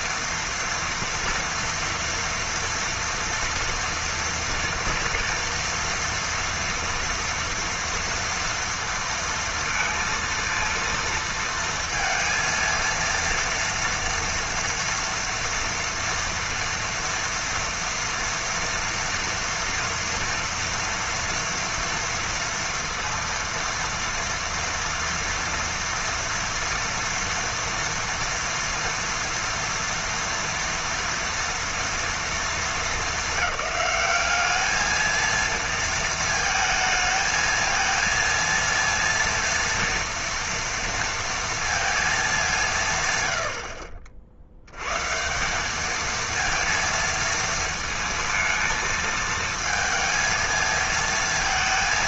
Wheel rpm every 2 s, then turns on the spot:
230, 230, 240, 230, 230, 230, 230, 230, 240, 230, 230, 230, 230, 230, 230, 230, 220, 200, 220, 230, 230, 190, 80, 230, 220, 220.
none